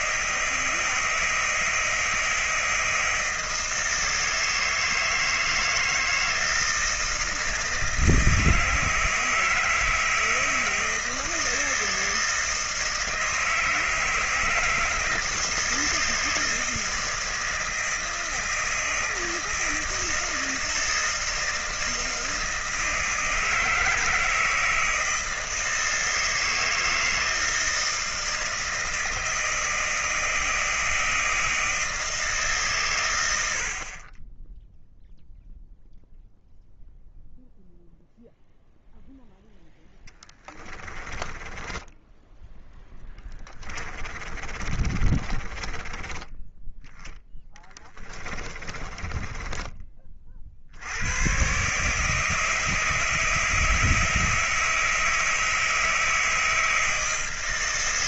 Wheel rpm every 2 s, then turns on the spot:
160, 160, 160, 160, 160, 160, 160, 160, 160, 160, 160, 160, 160, 160, 160, 160, 140, 10, 0, 0, 20, 10, 40, 10, 30, 60, 160, 160, 160.
40-46 48-50